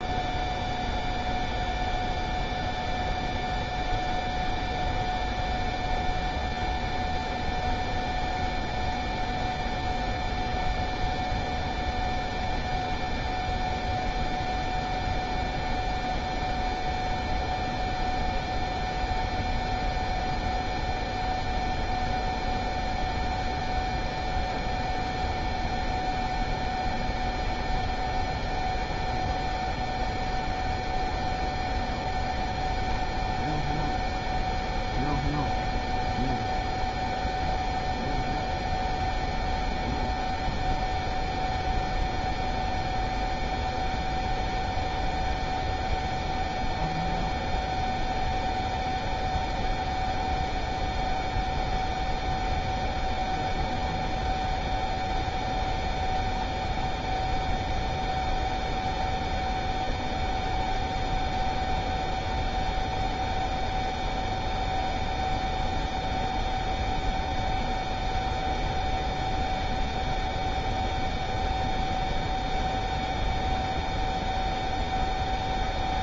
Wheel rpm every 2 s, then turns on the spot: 0, 0, 0, 0, 0, 0, 0, 0, 0, 0, 0, 0, 0, 0, 0, 0, 0, 0, 0, 0, 0, 0, 0, 0, 0, 0, 0, 0, 0, 0, 0, 0, 0, 0, 0, 0, 0, 0.
none